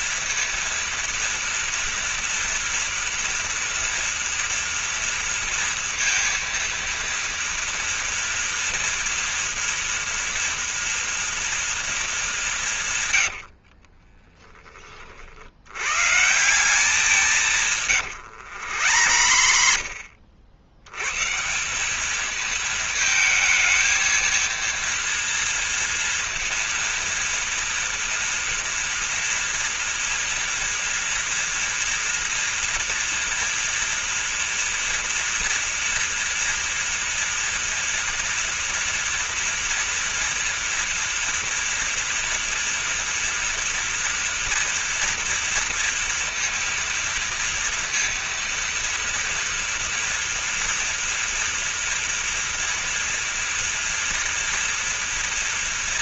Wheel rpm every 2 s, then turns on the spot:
240, 230, 230, 230, 230, 230, 160, 20, 180, 100, 100, 220, 230, 230, 230, 230, 230, 230, 240, 240, 230, 230, 230, 230, 230, 230, 230, 230.
18-20